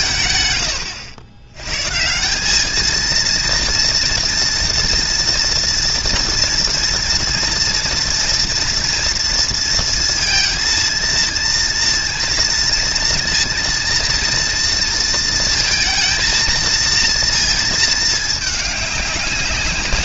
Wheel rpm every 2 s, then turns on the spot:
100, 230, 230, 230, 230, 230, 230, 230, 230, 200.
none